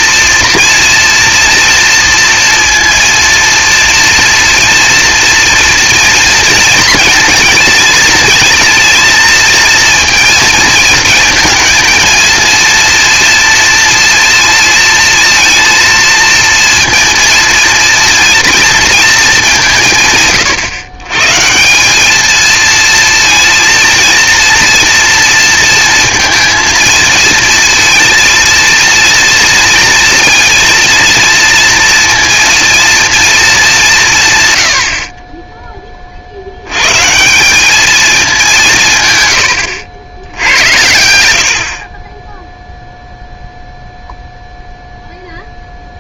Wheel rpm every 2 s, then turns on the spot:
230, 230, 230, 230, 230, 230, 230, 230, 230, 230, 150, 220, 230, 230, 230, 230, 230, 110, 90, 190, 80, 0, 0.
none